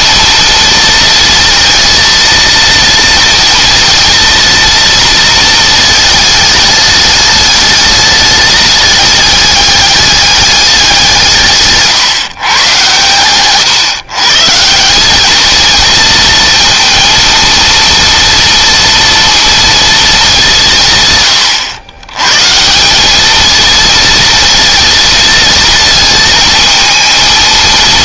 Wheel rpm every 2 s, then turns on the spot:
230, 230, 230, 210, 210, 190, 120, 200, 230, 240, 160, 190, 230, 220.
none